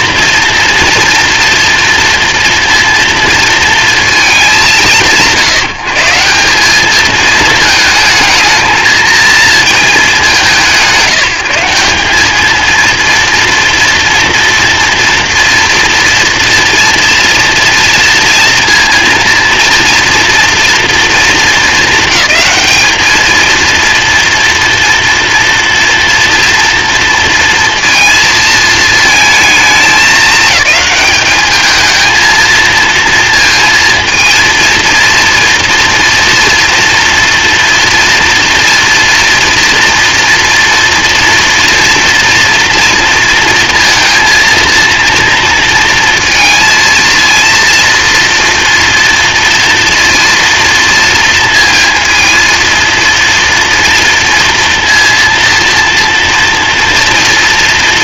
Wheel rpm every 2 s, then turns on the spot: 230, 230, 230, 160, 220, 210, 180, 230, 230, 230, 230, 220, 230, 230, 230, 220, 220, 230, 240, 230, 230, 230, 230, 230, 230, 230, 230, 230, 230.
none